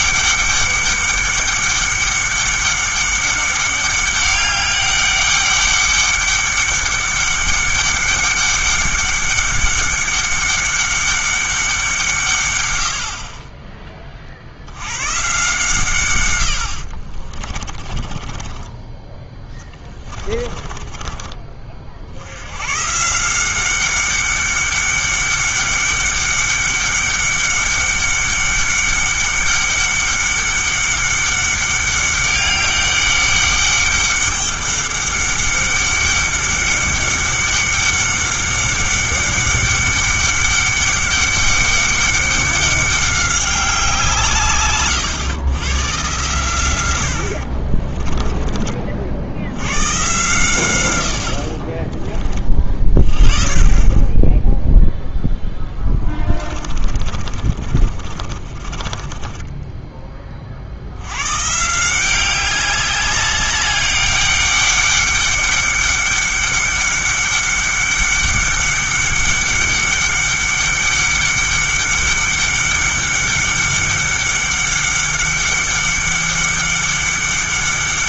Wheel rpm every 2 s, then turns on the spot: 200, 200, 200, 200, 200, 200, 70, 110, 70, 20, 20, 130, 200, 200, 200, 200, 200, 200, 200, 200, 200, 190, 130, 80, 40, 120, 30, 0, 40, 30, 90, 200, 200, 200, 200, 200, 200, 200, 200.
16-22 56-60